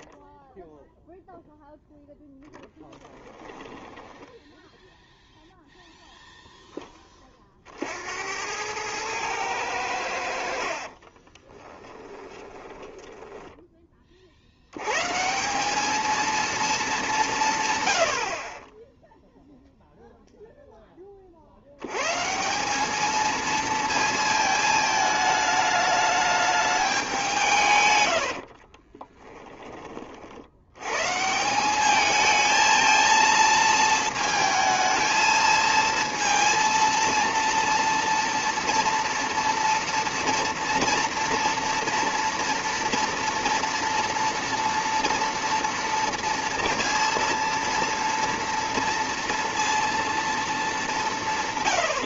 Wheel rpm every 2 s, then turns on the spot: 0, 10, 10, 10, 100, 40, 10, 90, 220, 20, 10, 200, 220, 200, 40, 100, 220, 220, 230, 230, 240, 230, 230, 230, 230, 200.
2-4 10-14 28-30